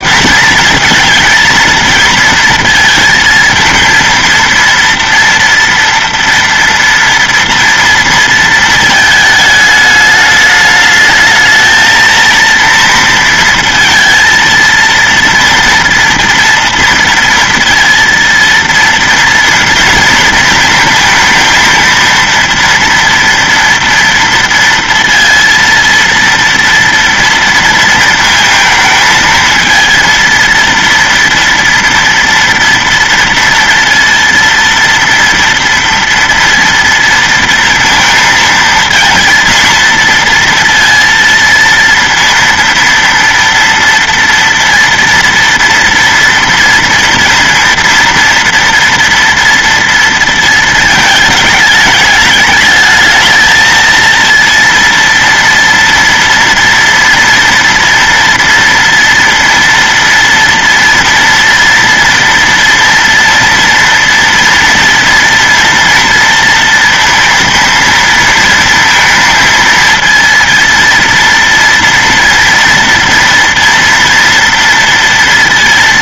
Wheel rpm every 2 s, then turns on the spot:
230, 230, 230, 230, 230, 210, 230, 230, 230, 230, 230, 230, 230, 230, 220, 230, 240, 230, 230, 230, 230, 230, 230, 230, 230, 230, 210, 230, 230, 230, 230, 230, 230, 230, 230, 230, 230, 230.
none